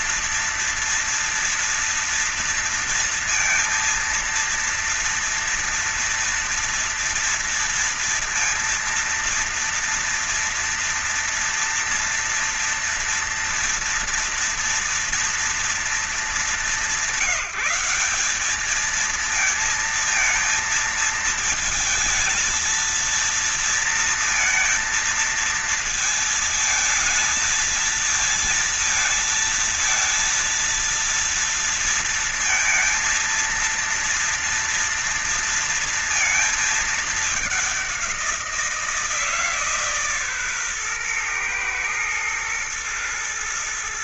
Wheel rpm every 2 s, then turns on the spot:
230, 230, 230, 230, 230, 230, 230, 230, 200, 200, 230, 220, 230, 220, 230, 230, 230, 230, 230, 180, 130, 120.
none